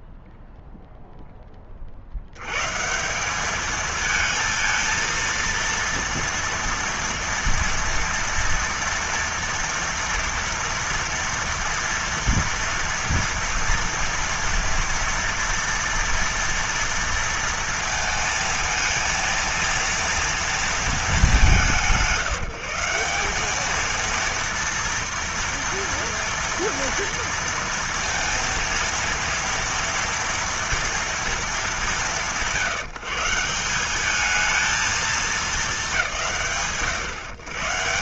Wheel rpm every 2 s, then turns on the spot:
0, 100, 230, 230, 240, 240, 230, 230, 230, 230, 230, 180, 230, 240, 230, 240, 160, 210, 140.
none